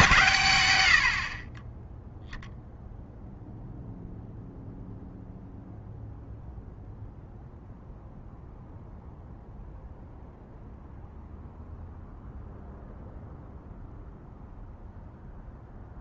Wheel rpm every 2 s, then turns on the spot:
120, 0, 0, 0, 0, 0, 0, 0.
none